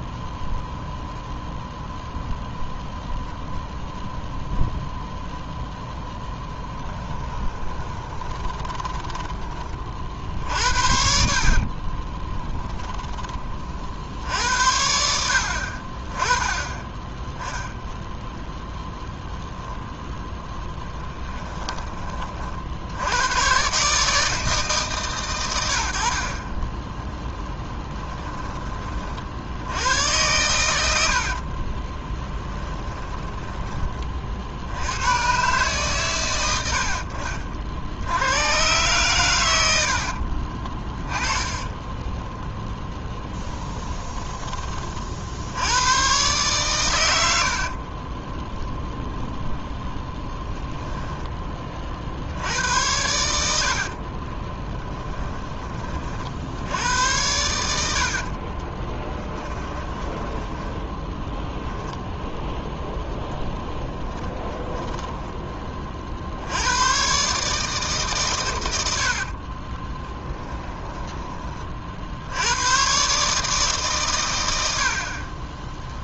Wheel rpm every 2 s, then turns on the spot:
0, 0, 0, 10, 10, 60, 10, 70, 30, 0, 10, 70, 140, 10, 30, 80, 10, 80, 70, 110, 30, 20, 40, 100, 10, 10, 90, 20, 80, 20, 10, 0, 10, 110, 80, 20, 120, 60.
6-12 20-22 30-34 40-42 50-52 54-56 58-62 64-66 70-72